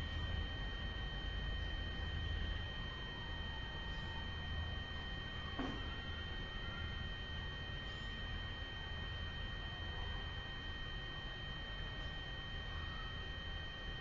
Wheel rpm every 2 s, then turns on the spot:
0, 0, 0, 0, 0, 0, 0.
none